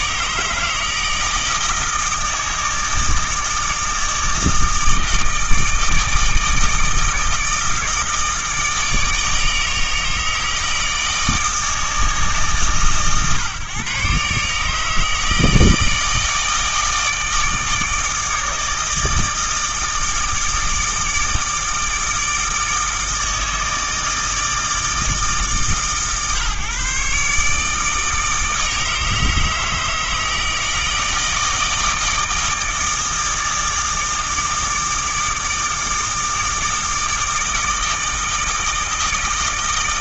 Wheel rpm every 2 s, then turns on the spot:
160, 160, 160, 160, 160, 160, 140, 150, 160, 160, 160, 160, 150, 140, 160, 160, 160, 160, 160, 160.
none